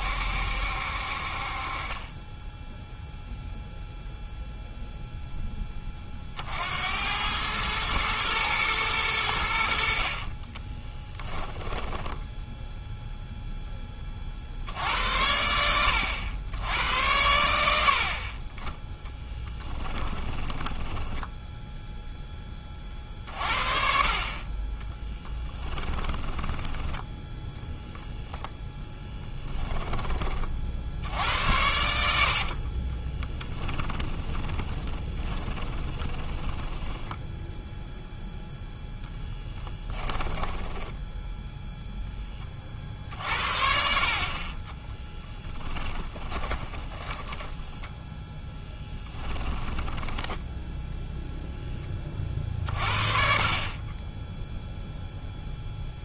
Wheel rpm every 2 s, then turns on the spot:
70, 10, 0, 60, 110, 20, 0, 60, 90, 20, 10, 20, 30, 10, 0, 50, 40, 20, 10, 0, 10, 30, 30, 20, 10, 10, 40, 0.
10-12 20-22 26-28 32-38 40-42 46-52